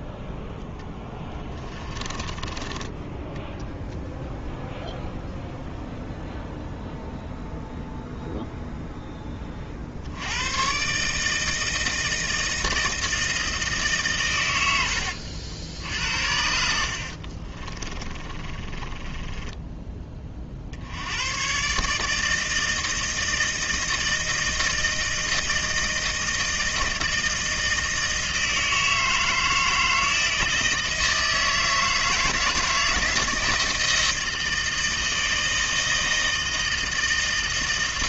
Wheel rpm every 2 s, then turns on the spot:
0, 20, 0, 0, 0, 110, 160, 100, 70, 30, 60, 160, 160, 160, 160, 160, 160, 160, 160.
2-4 16-20